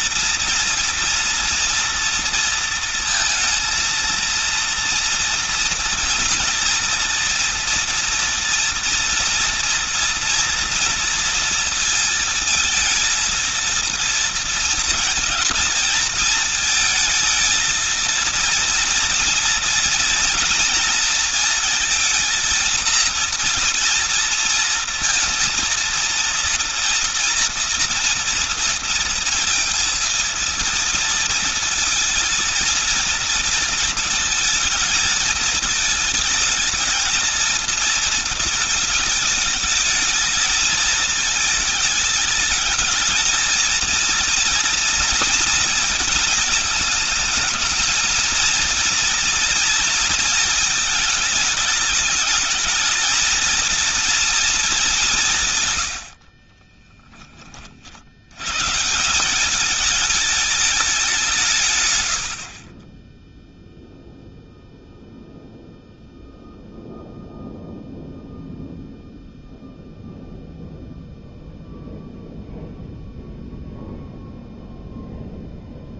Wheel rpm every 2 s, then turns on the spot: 230, 230, 230, 230, 230, 230, 220, 230, 220, 230, 230, 230, 230, 230, 230, 230, 230, 220, 220, 230, 220, 210, 230, 220, 230, 220, 210, 210, 30, 110, 210, 40, 0, 0, 0, 0, 0, 0.
56-58